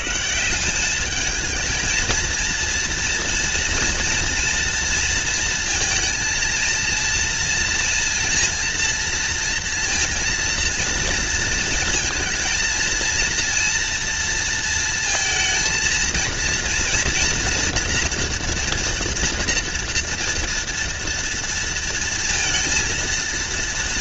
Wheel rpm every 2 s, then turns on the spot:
210, 230, 230, 230, 230, 230, 230, 230, 230, 230, 230, 230.
none